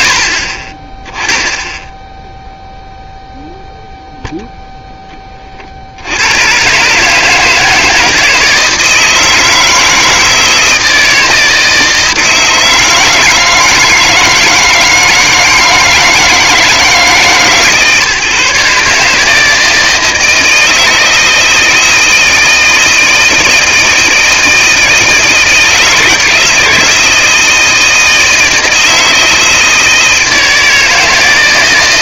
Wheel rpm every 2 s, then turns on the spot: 0, 0, 30, 150, 160, 160, 160, 160, 150, 160, 160, 160, 170, 170, 160, 160.
none